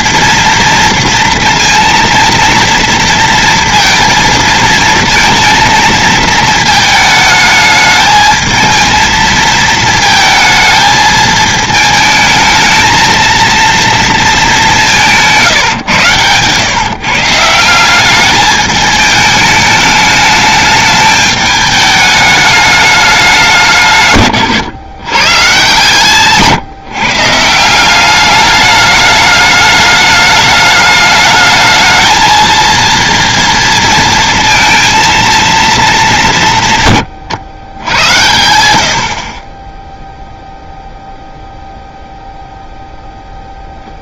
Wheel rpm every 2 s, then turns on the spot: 230, 230, 220, 220, 220, 220, 220, 190, 130, 210, 210, 210, 130, 140, 210, 210, 230, 230, 130, 70, 0, 0.
none